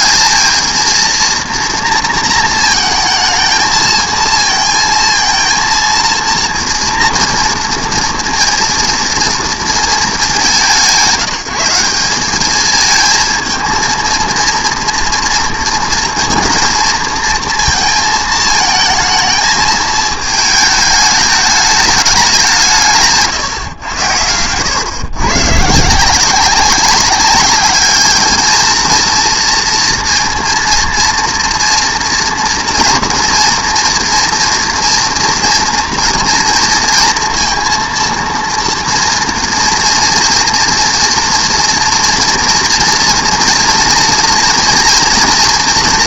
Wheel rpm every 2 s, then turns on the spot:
220, 230, 230, 230, 230, 180, 210, 230, 230, 220, 220, 180, 100, 190, 220, 230, 230, 230, 230, 240, 230, 230, 230.
none